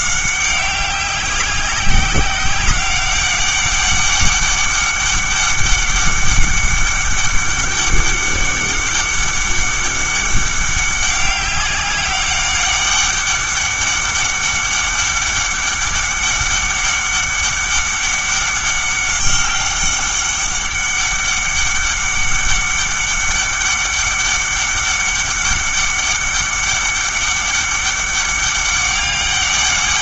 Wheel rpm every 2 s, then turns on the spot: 190, 190, 200, 200, 200, 200, 200, 200, 200, 200, 200, 200, 200, 200, 200.
none